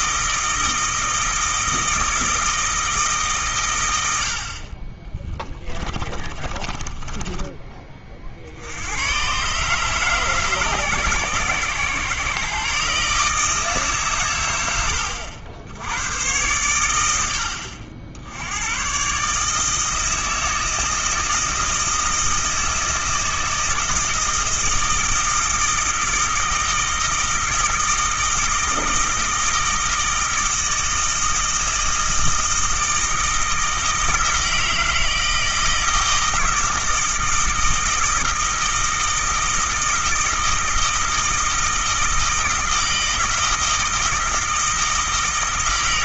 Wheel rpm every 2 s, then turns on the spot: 160, 150, 30, 20, 110, 140, 150, 90, 100, 120, 160, 160, 160, 160, 160, 160, 160, 160, 160, 160, 160, 160, 160.
4-8